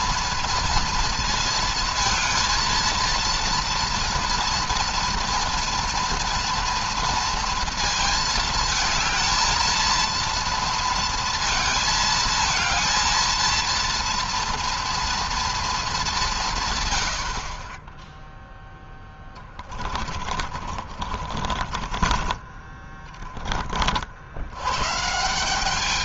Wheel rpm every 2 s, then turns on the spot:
230, 230, 230, 230, 230, 230, 220, 230, 170, 10, 40, 20, 90.
20-22